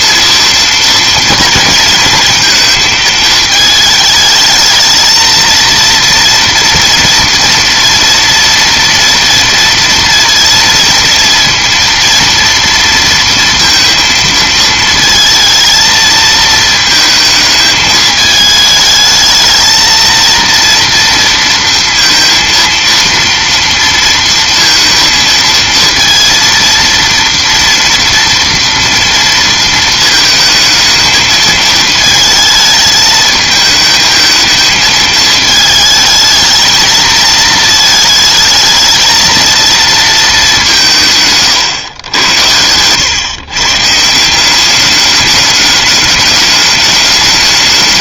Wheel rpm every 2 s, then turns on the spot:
230, 230, 220, 230, 230, 230, 230, 230, 220, 220, 230, 230, 230, 230, 230, 220, 220, 220, 220, 220, 190, 100, 190, 210.
none